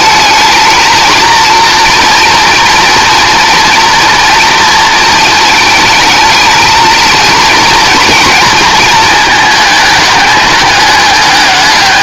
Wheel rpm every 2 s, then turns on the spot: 220, 230, 230, 220, 230, 210.
none